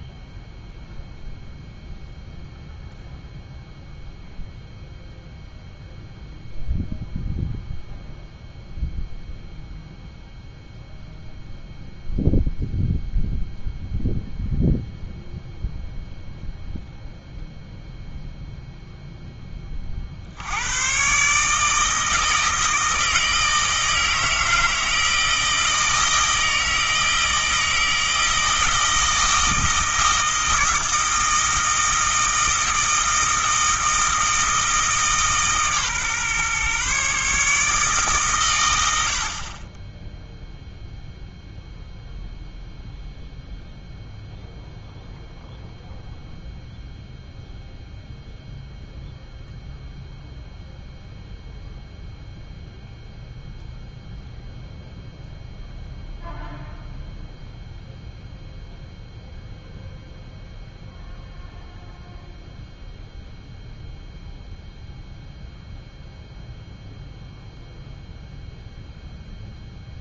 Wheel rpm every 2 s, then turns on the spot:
0, 0, 0, 0, 0, 0, 0, 0, 0, 0, 110, 160, 160, 160, 160, 160, 160, 160, 140, 80, 0, 0, 0, 0, 0, 0, 0, 0, 0, 0, 0, 0, 0, 0, 0.
none